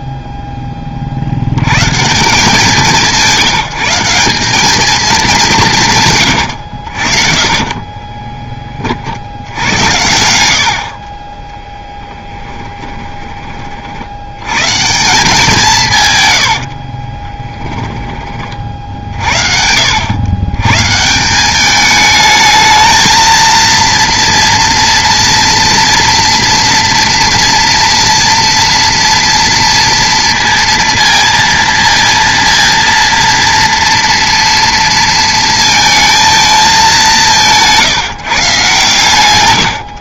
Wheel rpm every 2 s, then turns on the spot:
10, 170, 200, 100, 30, 80, 10, 110, 80, 40, 110, 220, 230, 230, 230, 230, 230, 230, 220, 130.
6-8 10-14 16-18